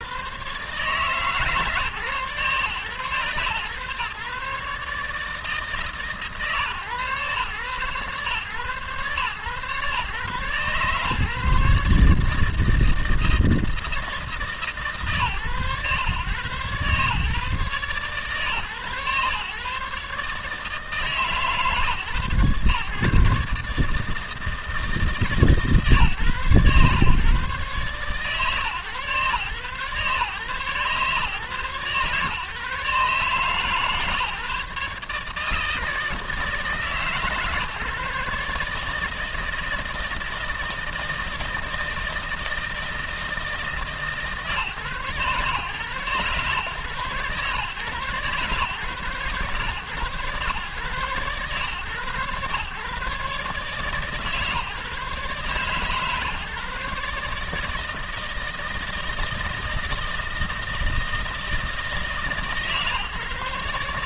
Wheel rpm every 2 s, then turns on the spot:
130, 130, 140, 130, 130, 140, 160, 150, 140, 130, 140, 120, 160, 130, 120, 140, 150, 150, 150, 150, 160, 160, 140, 120, 130, 120, 140, 150, 150, 160, 160, 140.
none